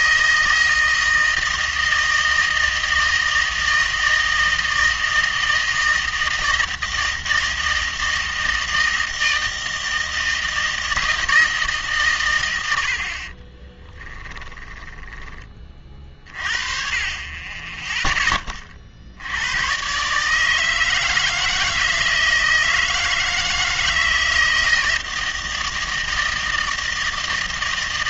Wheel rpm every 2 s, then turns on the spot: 160, 160, 160, 160, 160, 160, 100, 20, 40, 30, 160, 160, 160, 160.
14-16